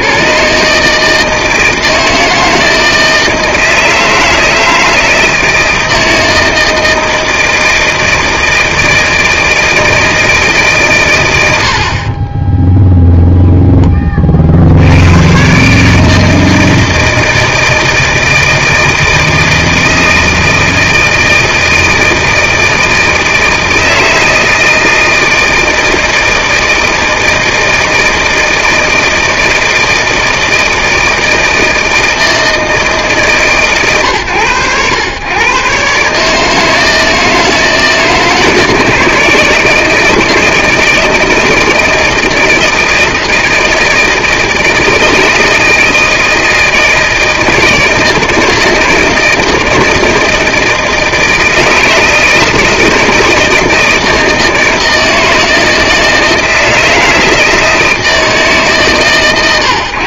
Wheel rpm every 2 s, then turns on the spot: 140, 160, 160, 160, 160, 130, 10, 70, 160, 160, 160, 160, 160, 160, 160, 160, 160, 110, 160, 160, 160, 160, 160, 160, 160, 160, 160, 160, 160, 150.
12-14